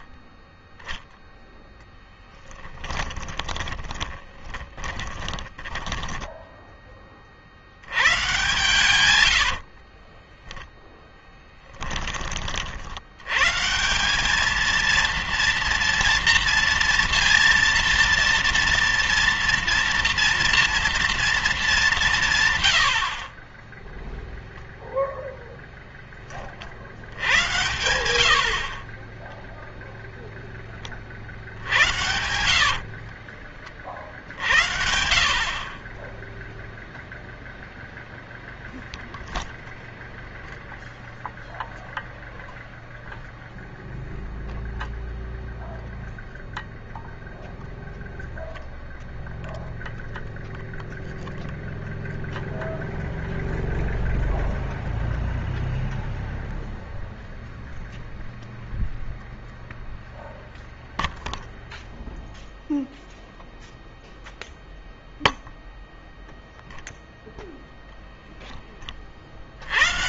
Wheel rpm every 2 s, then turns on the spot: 0, 10, 20, 20, 110, 10, 60, 230, 230, 230, 230, 100, 0, 60, 40, 30, 70, 60, 0, 0, 0, 0, 0, 0, 0, 0, 0, 0, 0, 0, 0, 0, 0, 0, 20.
2-6 8-12 28-30 32-34